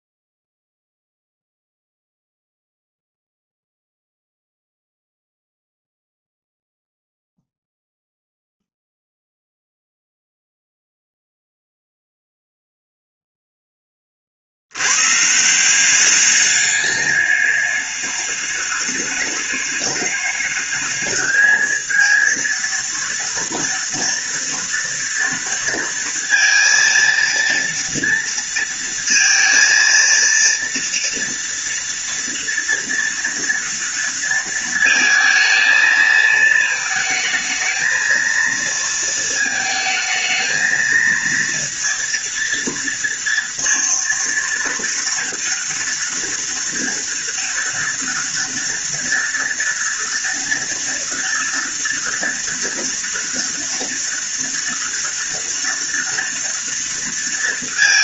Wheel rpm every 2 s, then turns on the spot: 0, 0, 0, 0, 0, 0, 0, 60, 200, 210, 210, 230, 230, 230, 230, 230, 230, 230, 220, 230, 220, 230, 230, 230, 230, 230, 230, 230, 230.
none